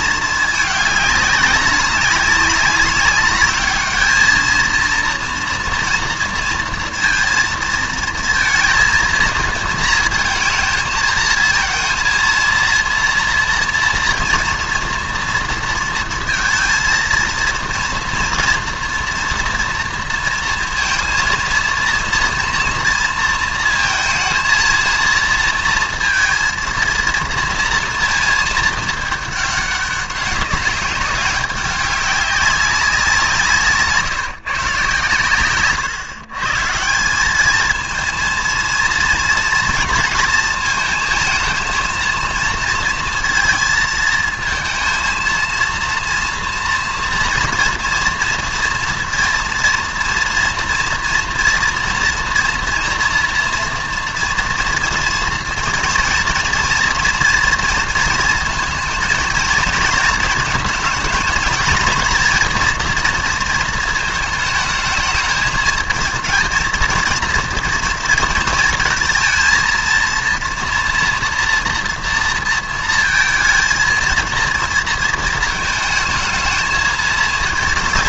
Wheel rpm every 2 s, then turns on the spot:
210, 200, 230, 230, 230, 230, 230, 230, 230, 230, 230, 230, 230, 220, 220, 200, 190, 140, 150, 230, 230, 220, 220, 240, 230, 230, 230, 230, 230, 230, 220, 230, 220, 220, 230, 230, 230, 230, 220.
none